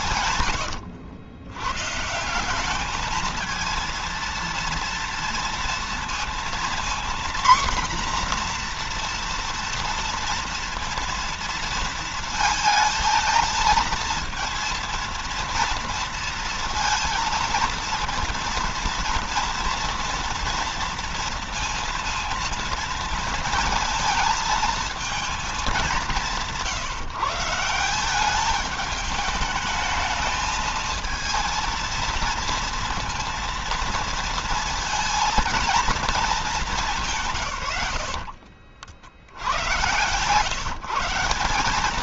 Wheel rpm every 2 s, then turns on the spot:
110, 210, 230, 240, 240, 230, 230, 230, 230, 230, 230, 230, 220, 160, 210, 220, 230, 230, 170, 60, 160.
none